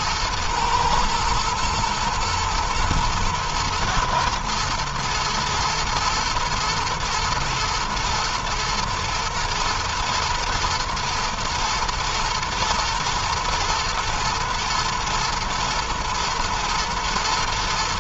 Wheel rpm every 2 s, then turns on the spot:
120, 110, 110, 120, 120, 110, 110, 110, 120.
none